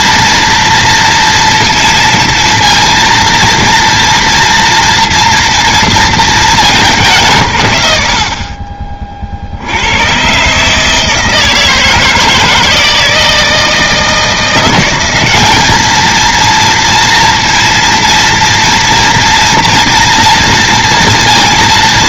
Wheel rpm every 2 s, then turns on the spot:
230, 230, 230, 190, 40, 140, 160, 180, 230, 230, 230.
none